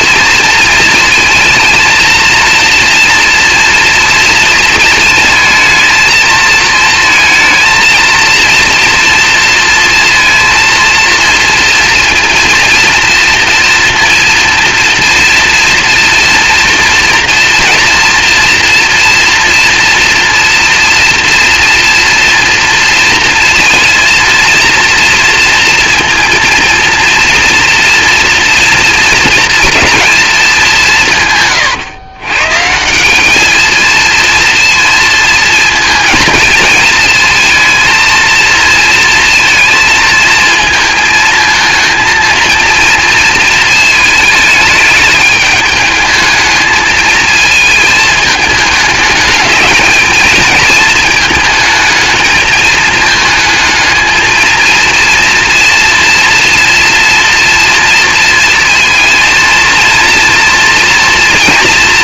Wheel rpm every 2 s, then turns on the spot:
230, 230, 230, 230, 230, 230, 230, 230, 240, 230, 230, 230, 230, 230, 230, 180, 170, 230, 220, 230, 220, 230, 210, 220, 210, 220, 220, 230, 240, 230, 230.
none